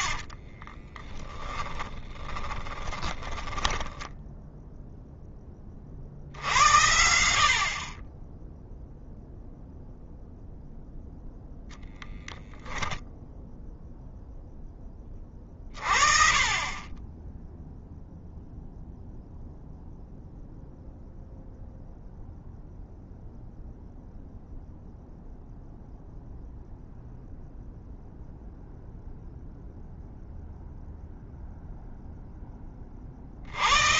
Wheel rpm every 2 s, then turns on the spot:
40, 20, 10, 70, 0, 0, 0, 10, 20, 0, 0, 0, 0, 0, 0, 0, 10.
0-4